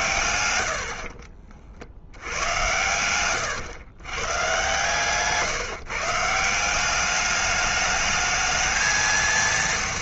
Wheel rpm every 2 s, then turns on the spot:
70, 100, 140, 190, 220.
none